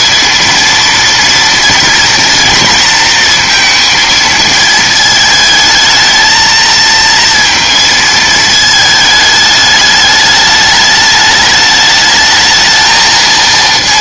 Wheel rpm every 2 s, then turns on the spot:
230, 230, 220, 230, 220, 210, 220.
none